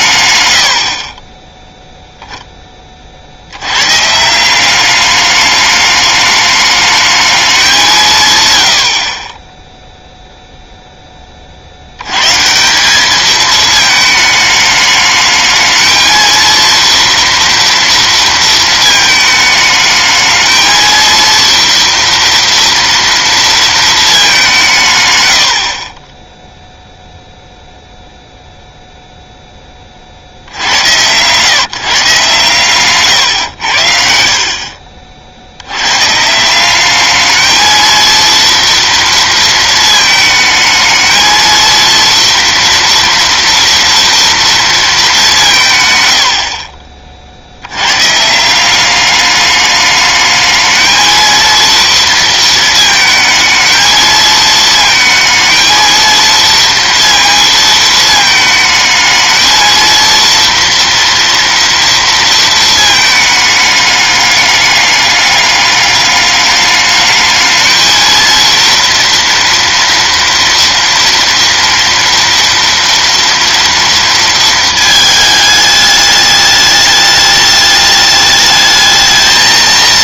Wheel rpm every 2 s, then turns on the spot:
0, 170, 210, 140, 0, 100, 210, 220, 230, 220, 230, 210, 20, 0, 10, 130, 100, 70, 220, 230, 230, 230, 170, 60, 200, 220, 220, 220, 230, 220, 230, 210, 200, 210, 230, 230, 230, 220, 210, 220.
none